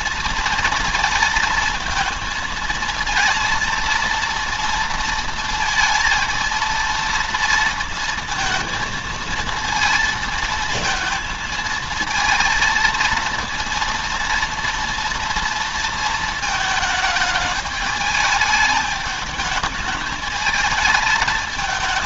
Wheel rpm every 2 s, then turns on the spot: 230, 220, 230, 230, 220, 230, 230, 230, 220, 210, 220.
none